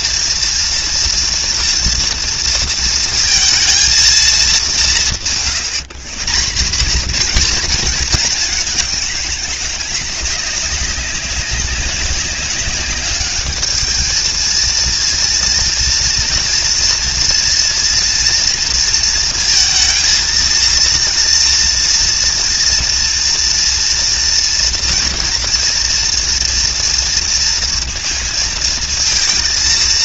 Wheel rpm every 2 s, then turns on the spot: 230, 230, 190, 210, 200, 190, 200, 230, 230, 230, 230, 230, 230, 230, 230.
none